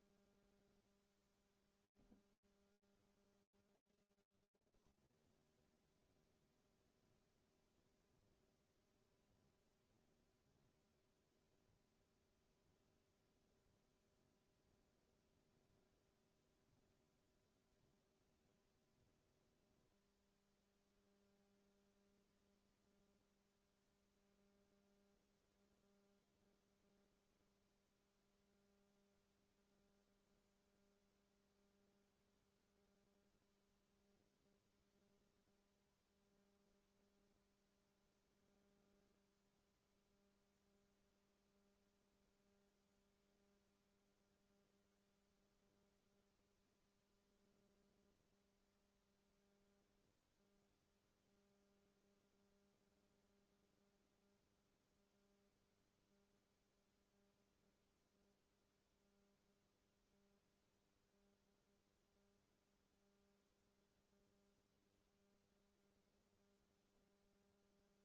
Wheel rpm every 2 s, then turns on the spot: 0, 0, 0, 0, 0, 0, 0, 0, 0, 0, 0, 0, 0, 0, 0, 0, 0, 0, 0, 0, 0, 0, 0, 0, 0, 0, 0, 0, 0, 0, 0, 0, 0, 0.
none